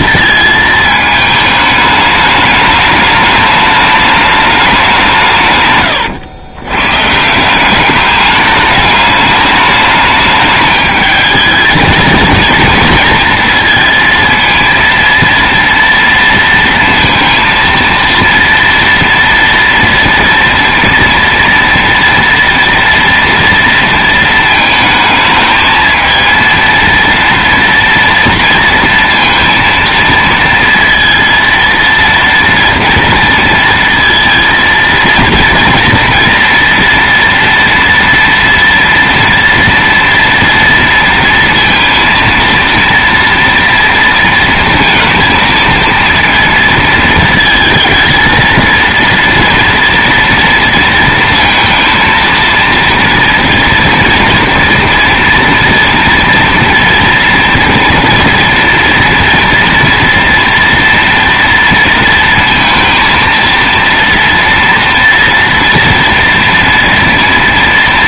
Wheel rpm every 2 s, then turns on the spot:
220, 210, 190, 120, 210, 210, 230, 230, 230, 230, 230, 230, 220, 230, 230, 230, 230, 230, 240, 230, 230, 230, 230, 230, 230, 230, 230, 230, 230, 230, 230, 230, 230, 230.
none